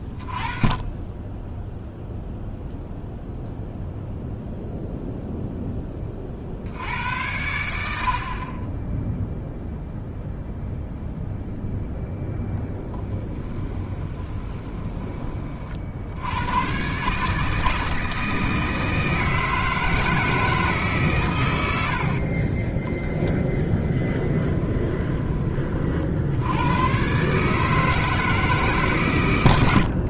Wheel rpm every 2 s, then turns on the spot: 30, 0, 0, 50, 30, 0, 0, 20, 110, 160, 150, 30, 20, 90, 150.
14-16 22-26